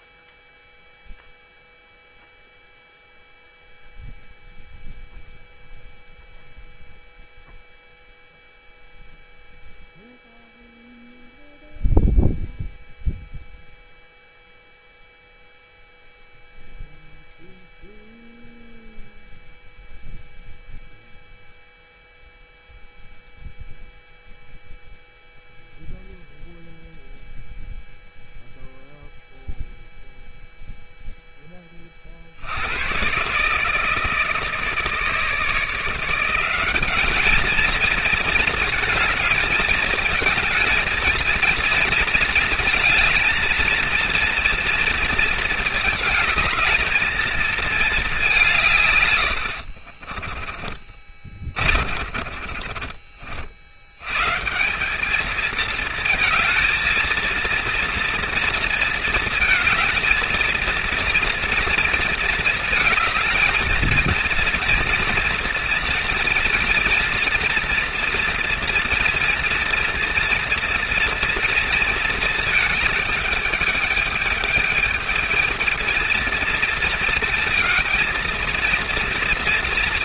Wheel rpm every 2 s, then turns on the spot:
0, 0, 0, 0, 0, 0, 0, 0, 0, 0, 0, 0, 0, 0, 0, 0, 90, 160, 190, 220, 220, 220, 230, 220, 170, 30, 40, 150, 230, 230, 230, 220, 230, 230, 230, 230, 220, 220, 230, 230.
50-54